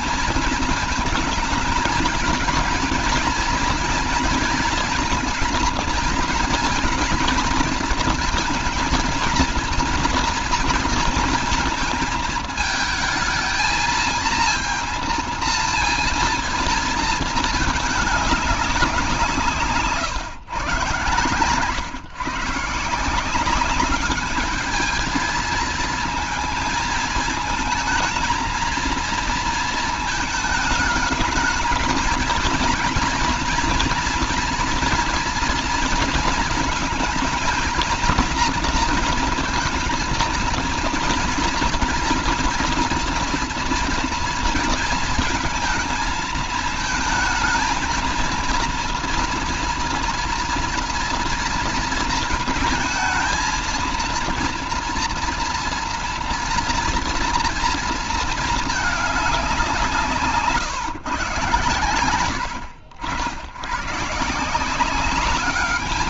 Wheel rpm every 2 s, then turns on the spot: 220, 230, 230, 230, 230, 230, 220, 230, 220, 170, 130, 180, 220, 220, 230, 220, 230, 240, 230, 230, 230, 230, 220, 220, 230, 230, 230, 230, 230, 210, 140, 80, 200.
none